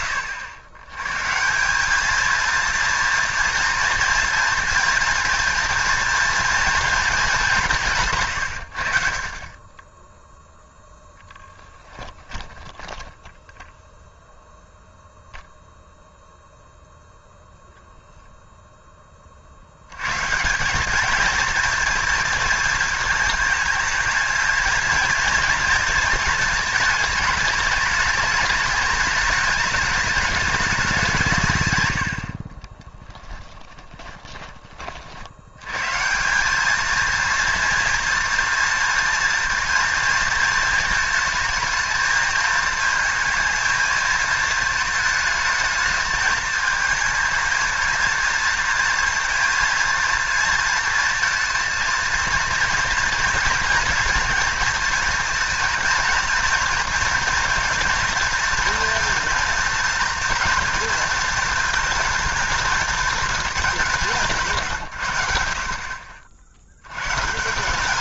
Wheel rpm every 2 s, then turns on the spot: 110, 230, 230, 210, 60, 10, 0, 0, 0, 40, 220, 220, 230, 210, 210, 160, 20, 80, 230, 230, 220, 230, 220, 220, 230, 230, 230, 230, 230, 230, 230, 230, 140, 70.
10-12 32-34